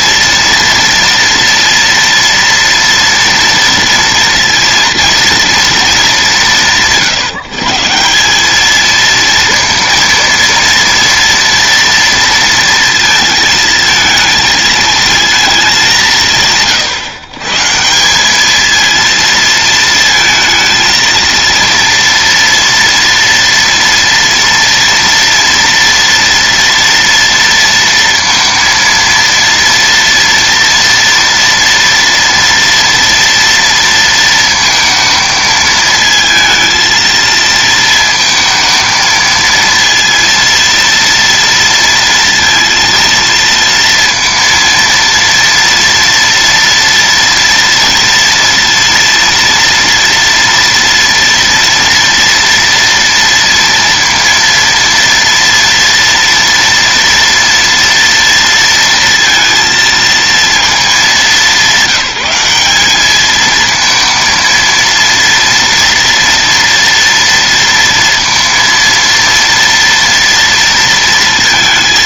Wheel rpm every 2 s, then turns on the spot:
230, 240, 230, 150, 220, 230, 230, 220, 130, 220, 230, 230, 240, 230, 230, 230, 230, 230, 230, 230, 230, 230, 230, 230, 230, 230, 230, 230, 230, 230, 210, 200, 230, 240, 230, 230.
none